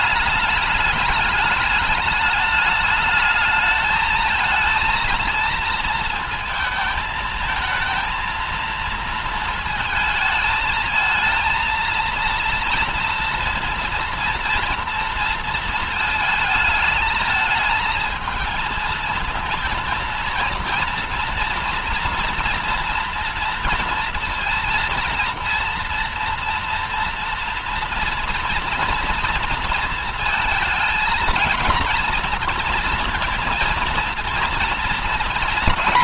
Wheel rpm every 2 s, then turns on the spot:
210, 210, 220, 220, 230, 220, 230, 230, 220, 230, 230, 230, 230, 230, 230, 230, 230, 240.
none